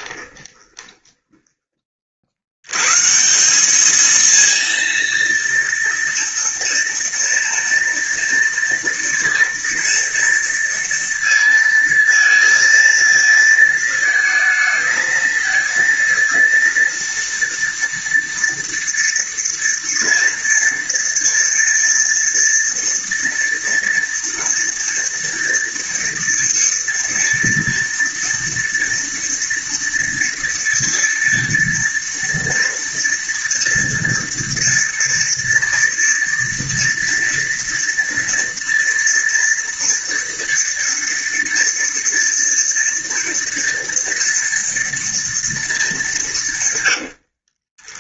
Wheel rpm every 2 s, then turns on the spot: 10, 130, 230, 230, 230, 230, 230, 220, 230, 230, 230, 230, 230, 230, 230, 230, 230, 230, 230, 230, 230, 230, 230, 120.
0-2 46-48